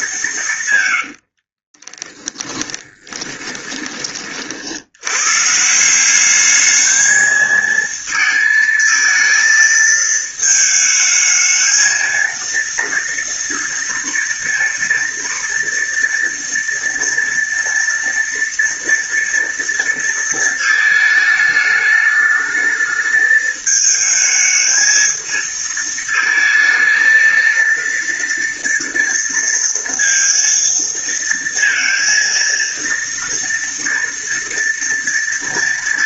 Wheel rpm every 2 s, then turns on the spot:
170, 10, 50, 210, 220, 220, 230, 230, 230, 230, 230, 220, 220, 220, 230, 230, 230, 230.
2-4